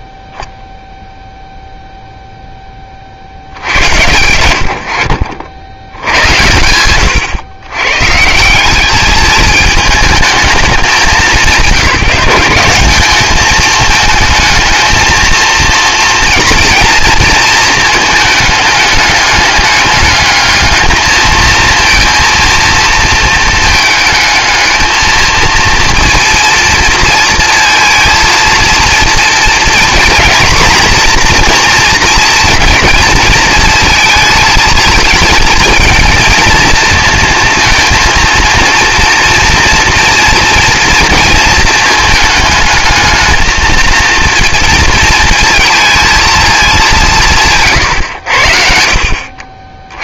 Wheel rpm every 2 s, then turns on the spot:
0, 20, 80, 100, 180, 210, 190, 220, 230, 210, 220, 230, 220, 230, 230, 230, 230, 220, 230, 230, 240, 210, 230, 210, 50.
none